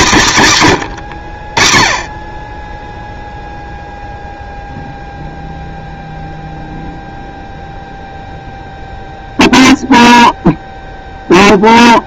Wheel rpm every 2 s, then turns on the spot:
130, 10, 0, 0, 0, 0.
none